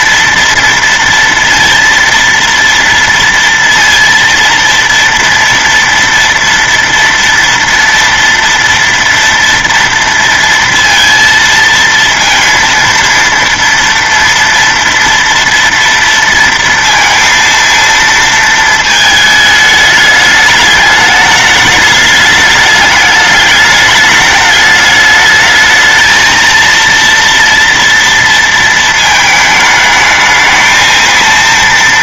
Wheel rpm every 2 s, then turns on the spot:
230, 230, 230, 230, 230, 230, 230, 230, 230, 230, 210, 210, 210, 230, 230, 220.
none